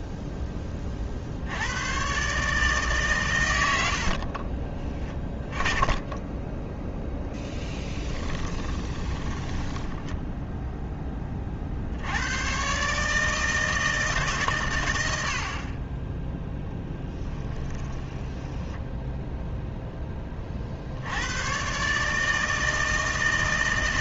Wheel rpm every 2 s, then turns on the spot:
70, 100, 20, 0, 10, 30, 160, 60, 10, 0, 90, 160.
8-10 16-18